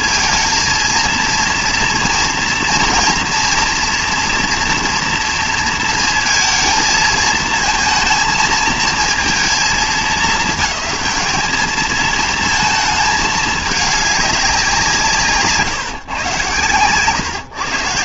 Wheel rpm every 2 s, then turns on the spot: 230, 230, 230, 220, 220, 210, 220, 190, 120.
none